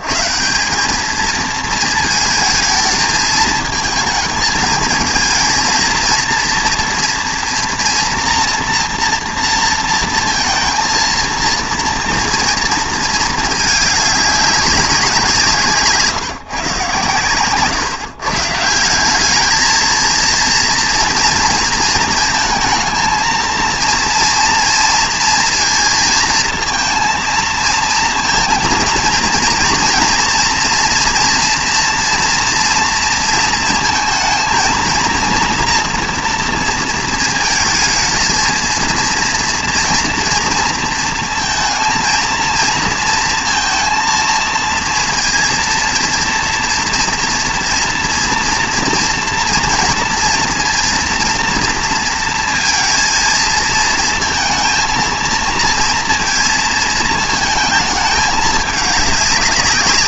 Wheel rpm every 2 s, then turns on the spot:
130, 220, 220, 230, 230, 230, 230, 200, 140, 160, 230, 230, 230, 220, 230, 230, 230, 230, 230, 230, 230, 230, 230, 230, 230, 230, 230, 230, 220, 210.
none